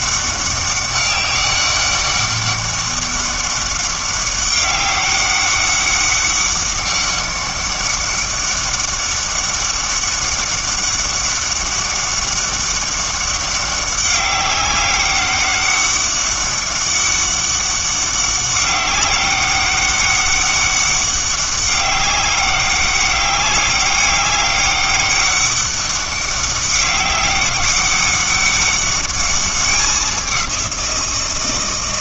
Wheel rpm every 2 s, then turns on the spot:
200, 200, 200, 200, 200, 200, 190, 200, 200, 200, 200, 200, 200, 200, 200, 180.
none